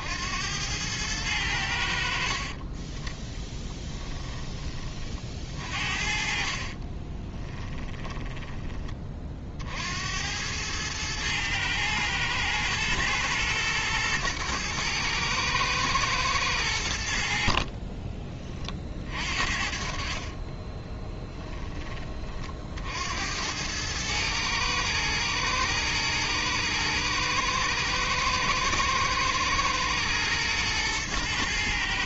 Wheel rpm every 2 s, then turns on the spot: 100, 20, 30, 40, 20, 110, 110, 110, 80, 40, 10, 70, 110, 110, 120, 110.
6-8 20-22